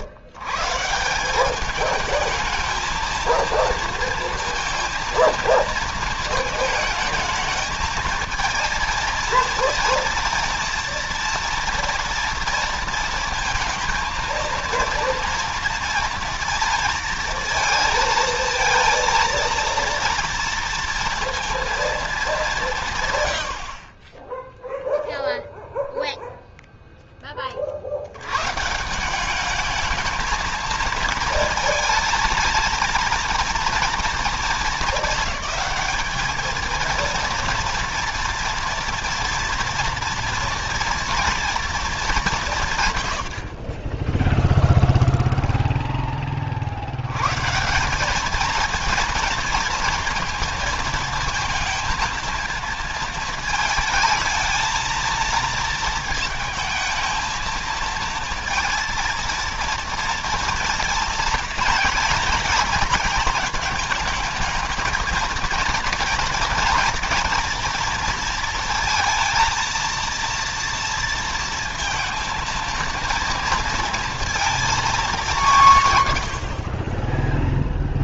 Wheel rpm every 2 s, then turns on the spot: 130, 220, 230, 220, 230, 230, 230, 230, 230, 230, 230, 170, 0, 0, 140, 220, 230, 220, 230, 240, 240, 150, 0, 50, 230, 230, 220, 230, 220, 230, 230, 230, 220, 230, 230, 230, 230, 220, 50.
none